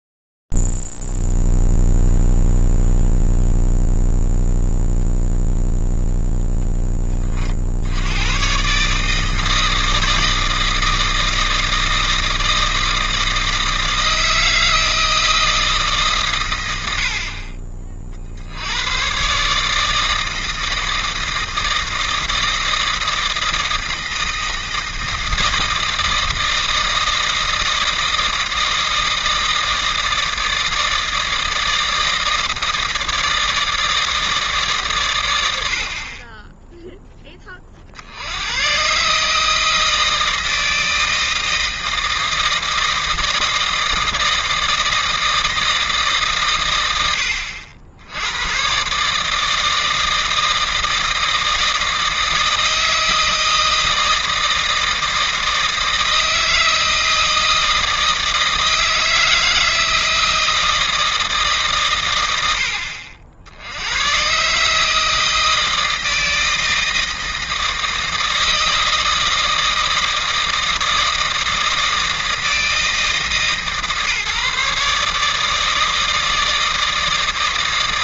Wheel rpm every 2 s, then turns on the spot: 0, 0, 0, 0, 100, 160, 160, 160, 130, 60, 160, 160, 160, 160, 160, 160, 160, 160, 20, 110, 160, 160, 160, 120, 120, 160, 160, 160, 160, 160, 160, 90, 150, 160, 160, 160, 160, 150, 160.
none